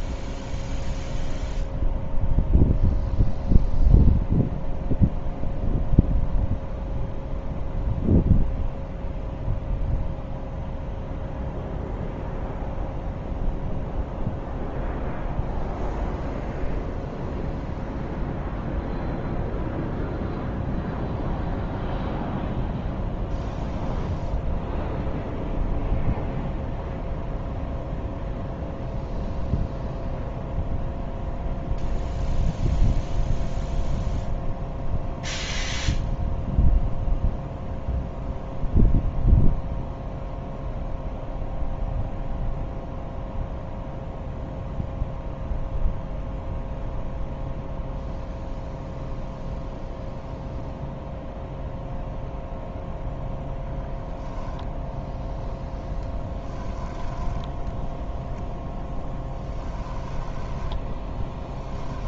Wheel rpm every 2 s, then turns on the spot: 0, 0, 0, 0, 0, 0, 0, 0, 0, 0, 0, 0, 0, 0, 0, 0, 0, 0, 0, 0, 0, 0, 0, 0, 0, 0, 10, 10, 10, 0, 10.
56-58 60-62